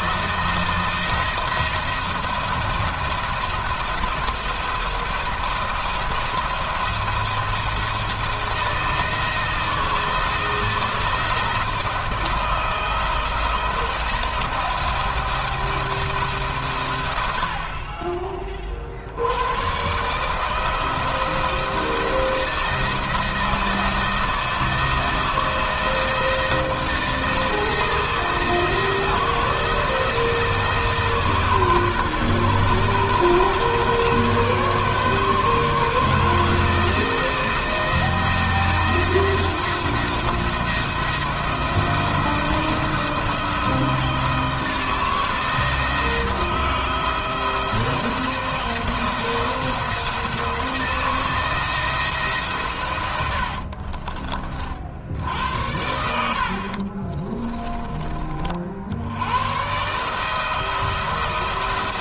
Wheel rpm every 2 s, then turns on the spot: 170, 170, 170, 170, 170, 160, 170, 170, 120, 40, 160, 170, 160, 170, 160, 160, 140, 150, 160, 170, 170, 170, 160, 160, 170, 160, 130, 50, 40, 60, 160.
52-54 56-58